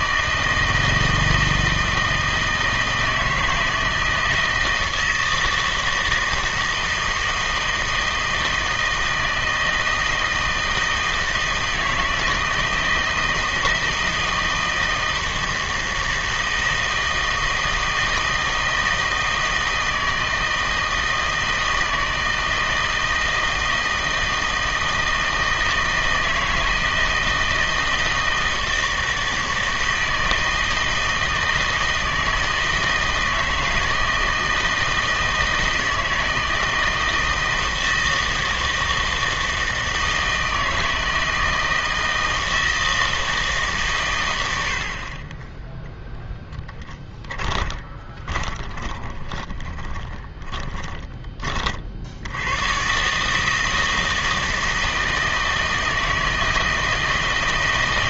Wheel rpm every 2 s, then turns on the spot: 160, 160, 160, 160, 160, 160, 160, 160, 160, 160, 160, 160, 160, 160, 160, 160, 160, 160, 160, 160, 160, 160, 70, 10, 20, 10, 100, 160, 160.
46-52